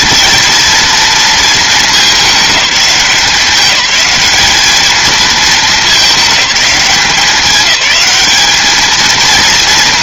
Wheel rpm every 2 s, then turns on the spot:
230, 190, 210, 200, 210.
none